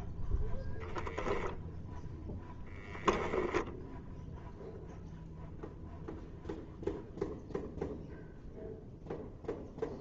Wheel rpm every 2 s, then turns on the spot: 0, 10, 0, 0, 0.
2-4